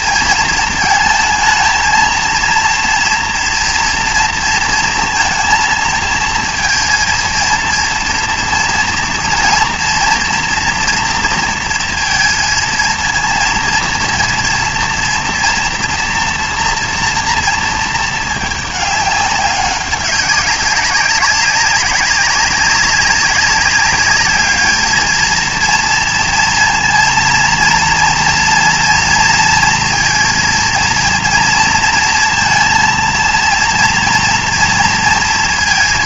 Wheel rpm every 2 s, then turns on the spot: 220, 230, 230, 230, 230, 240, 230, 230, 240, 210, 190, 200, 210, 230, 230, 230, 230, 230.
none